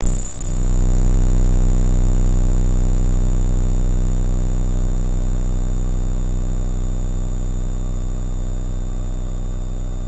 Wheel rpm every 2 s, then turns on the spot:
0, 0, 0, 0, 0.
none